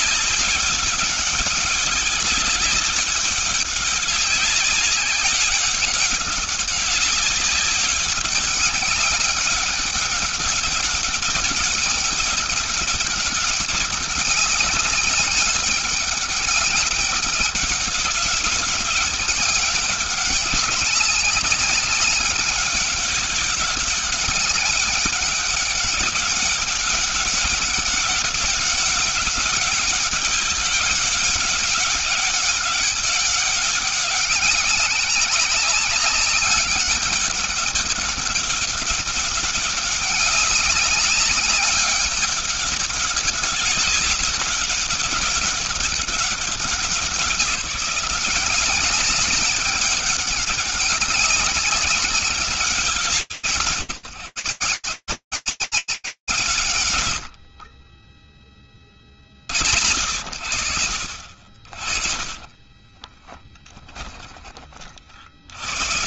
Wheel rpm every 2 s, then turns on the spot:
200, 200, 190, 200, 190, 200, 200, 200, 190, 200, 190, 190, 200, 200, 200, 200, 200, 190, 200, 190, 200, 200, 190, 180, 190, 200, 170, 150, 140, 40, 70, 30, 70.
62-64